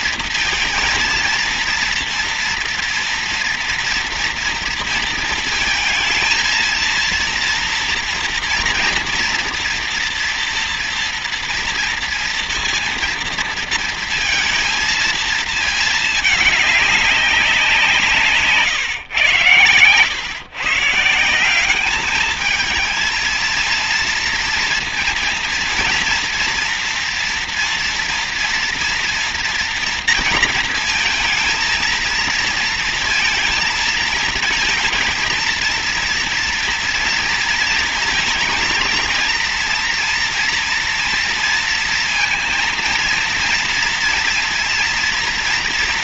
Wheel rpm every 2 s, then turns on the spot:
230, 230, 230, 230, 230, 230, 230, 230, 200, 130, 160, 220, 230, 230, 230, 230, 230, 230, 230, 230, 230, 230, 230.
none